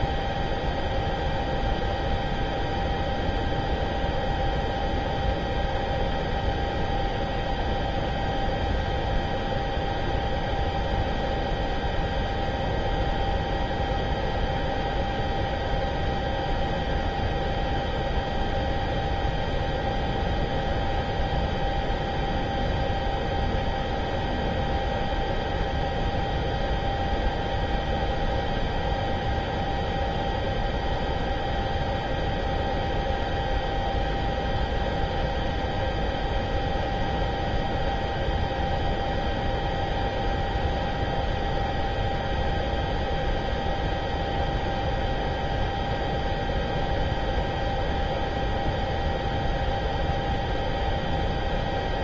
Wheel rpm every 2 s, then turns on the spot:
0, 0, 0, 0, 0, 0, 0, 0, 0, 0, 0, 0, 0, 0, 0, 0, 0, 0, 0, 0, 0, 0, 0, 0, 0, 0.
none